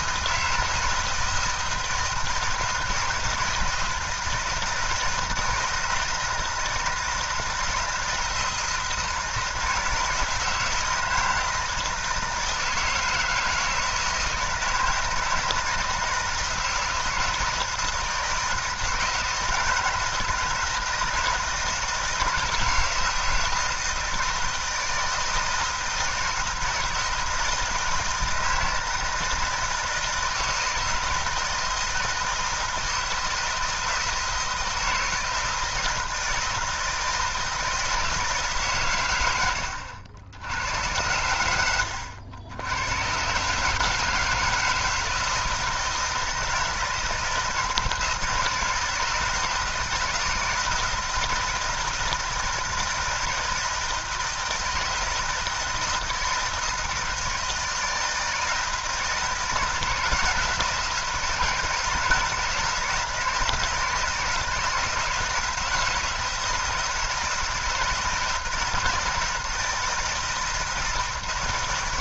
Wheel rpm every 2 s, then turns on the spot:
160, 160, 160, 160, 160, 160, 160, 160, 160, 160, 160, 160, 160, 160, 160, 160, 160, 160, 160, 120, 90, 110, 160, 160, 160, 160, 160, 160, 160, 160, 160, 160, 160, 160, 170, 160.
none